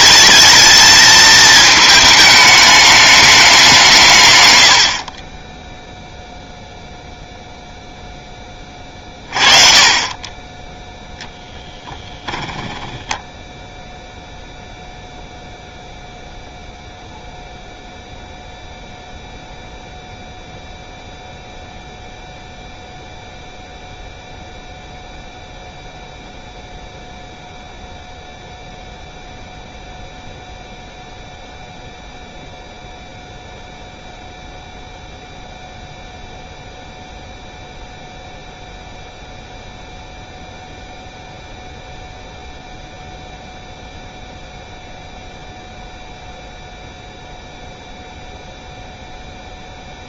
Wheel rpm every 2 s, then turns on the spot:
230, 200, 40, 0, 20, 10, 10, 0, 0, 0, 0, 0, 0, 0, 0, 0, 0, 0, 0, 0, 0, 0, 0, 0, 0.
12-14